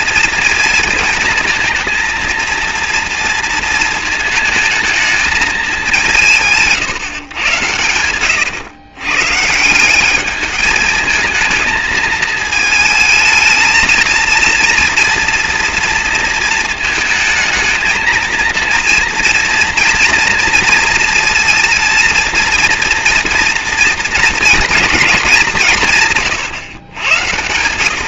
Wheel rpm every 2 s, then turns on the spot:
230, 230, 220, 160, 120, 210, 220, 230, 220, 230, 230, 230, 230, 120.
none